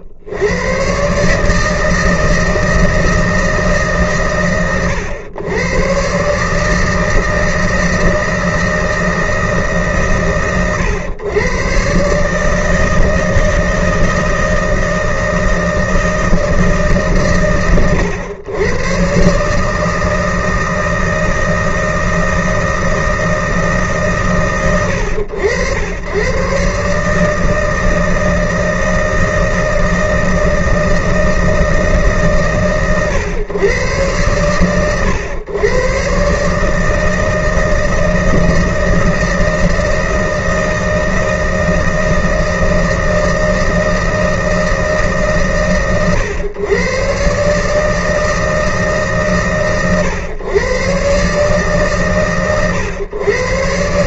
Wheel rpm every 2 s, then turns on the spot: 90, 160, 110, 140, 160, 110, 150, 160, 160, 110, 160, 160, 100, 120, 160, 160, 130, 110, 140, 160, 160, 160, 160, 110, 160, 120, 130.
none